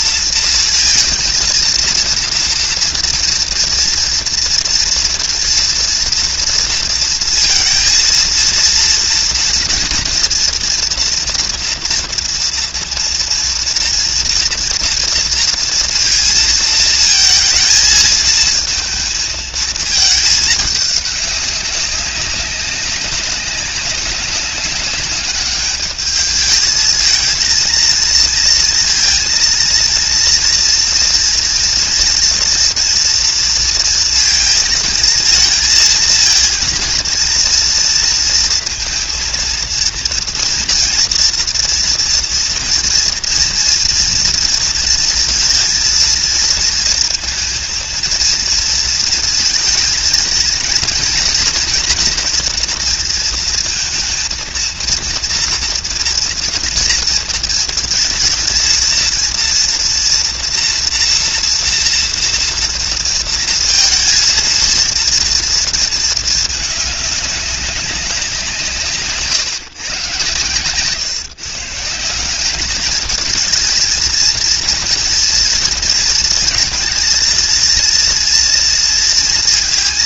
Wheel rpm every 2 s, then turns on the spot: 230, 230, 230, 230, 230, 230, 230, 230, 230, 230, 210, 190, 200, 220, 230, 230, 230, 220, 230, 230, 230, 230, 230, 230, 230, 230, 230, 230, 230, 230, 230, 230, 230, 210, 170, 130, 200, 230, 230, 230.
none